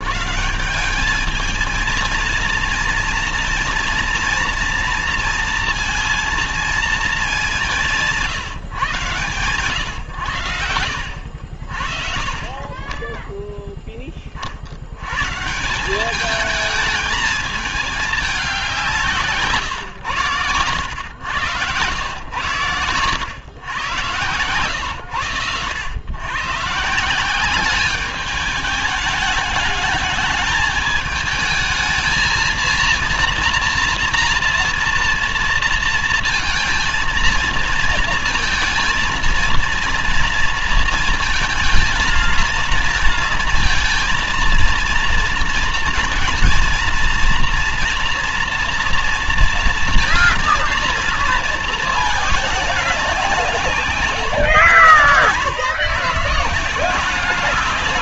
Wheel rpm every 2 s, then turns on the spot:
160, 230, 230, 230, 140, 100, 30, 50, 210, 200, 120, 120, 110, 130, 210, 220, 230, 230, 230, 230, 230, 230, 230, 230, 230, 230, 210, 120, 160.
20-22